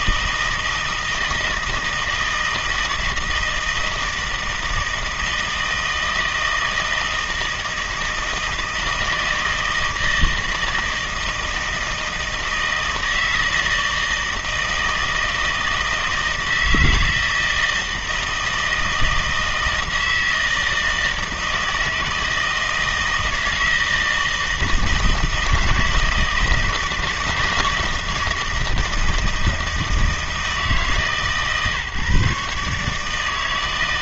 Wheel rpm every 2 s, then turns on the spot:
160, 160, 160, 160, 160, 160, 160, 160, 160, 160, 160, 160, 160, 160, 160, 150, 150.
none